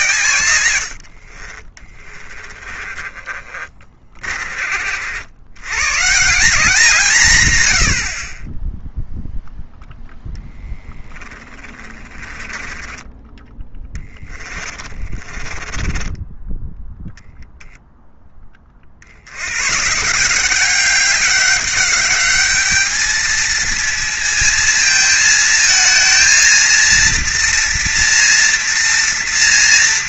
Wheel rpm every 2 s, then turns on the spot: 100, 20, 50, 180, 10, 10, 20, 40, 10, 40, 190, 210, 220, 230, 240.
2-4 12-18